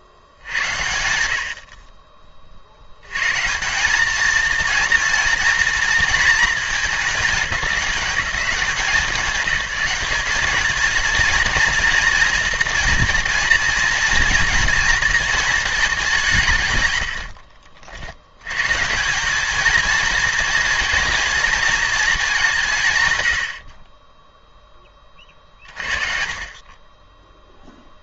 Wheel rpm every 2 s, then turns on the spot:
90, 70, 230, 210, 170, 220, 230, 230, 120, 140, 230, 140, 10, 20.
none